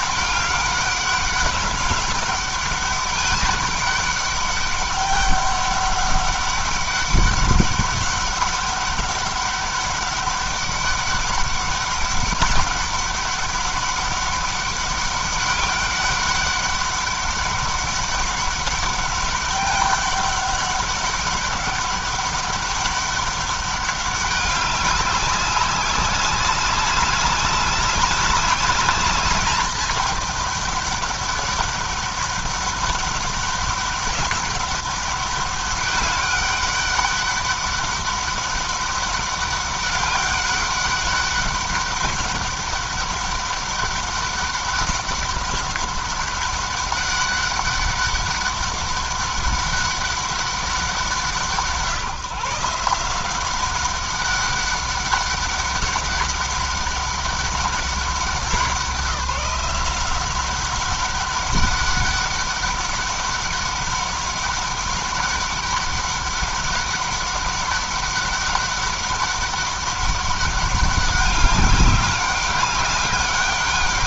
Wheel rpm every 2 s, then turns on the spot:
200, 200, 200, 200, 200, 190, 200, 200, 200, 200, 200, 200, 200, 200, 210, 200, 200, 200, 200, 200, 200, 200, 200, 200, 200, 190, 170, 200, 200, 190, 190, 200, 190, 200, 200, 200, 200.
none